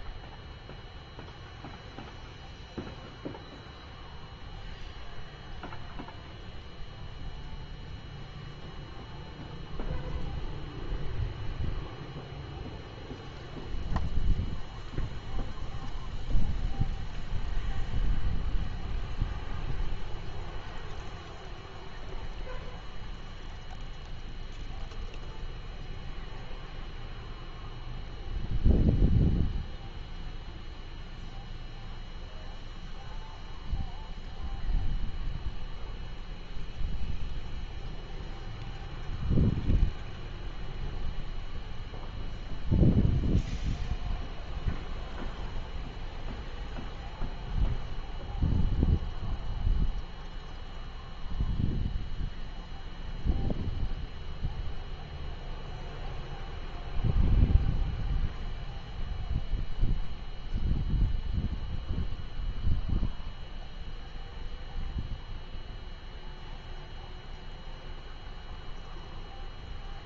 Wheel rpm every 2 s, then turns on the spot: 0, 0, 0, 0, 0, 0, 0, 0, 0, 0, 0, 0, 0, 0, 0, 0, 0, 0, 0, 0, 0, 0, 0, 0, 0, 0, 0, 0, 0, 0, 0, 0, 0, 0, 0.
none